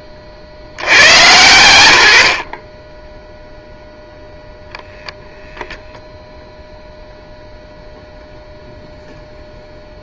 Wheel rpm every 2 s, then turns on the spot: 90, 20, 0, 0, 0.
none